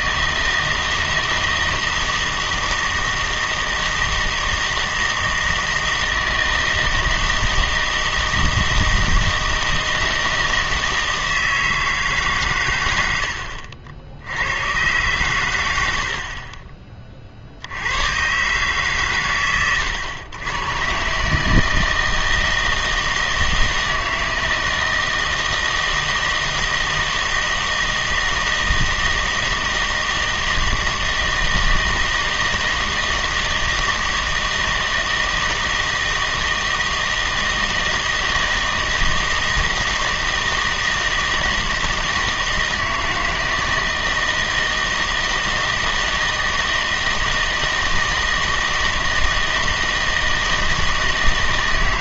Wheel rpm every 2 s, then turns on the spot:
160, 160, 160, 160, 160, 160, 120, 110, 30, 140, 110, 160, 160, 160, 160, 160, 160, 160, 160, 160, 160, 160, 160, 160, 160, 160.
none